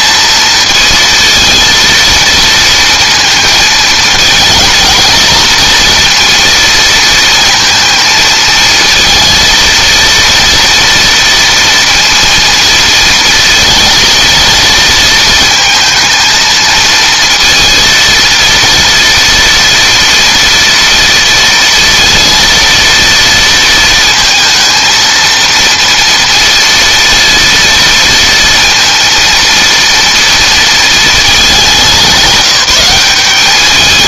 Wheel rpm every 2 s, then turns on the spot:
230, 230, 230, 230, 230, 230, 230, 230, 220, 230, 230, 230, 230, 230, 230, 220, 200.
none